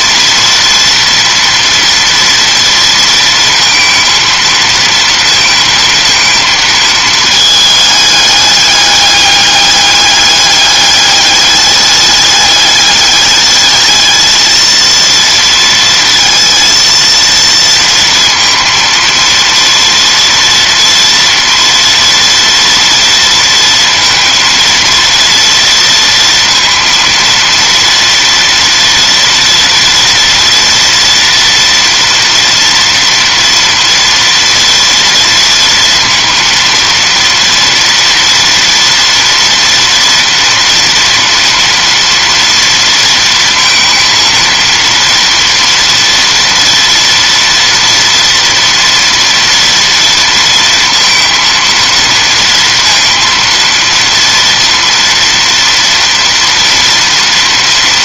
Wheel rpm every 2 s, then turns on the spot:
230, 230, 230, 220, 200, 200, 210, 230, 230, 230, 230, 230, 230, 230, 230, 240, 230, 230, 230, 230, 240, 230, 230, 230, 240, 230, 230, 230, 230.
none